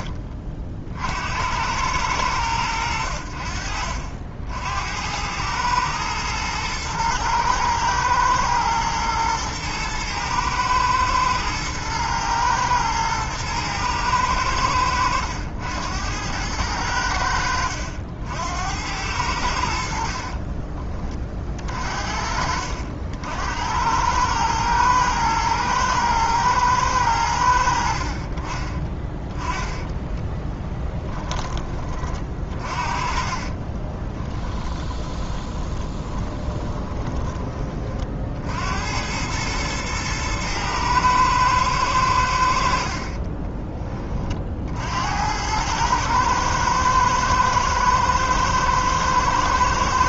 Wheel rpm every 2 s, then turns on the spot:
40, 90, 70, 110, 120, 110, 110, 100, 90, 80, 30, 60, 110, 110, 30, 10, 30, 10, 20, 70, 110, 60, 60, 110, 110.
20-22 30-38